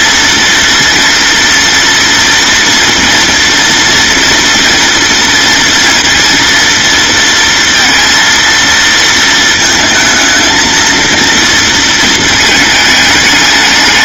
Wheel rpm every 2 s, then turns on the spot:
230, 230, 230, 230, 230, 230, 210.
none